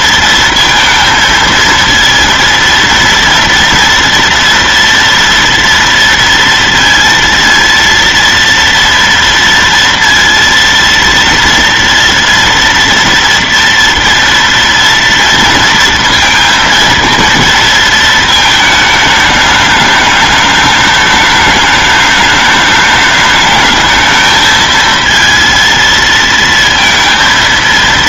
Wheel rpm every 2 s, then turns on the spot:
230, 230, 230, 230, 230, 230, 230, 230, 230, 220, 210, 210, 220, 230.
none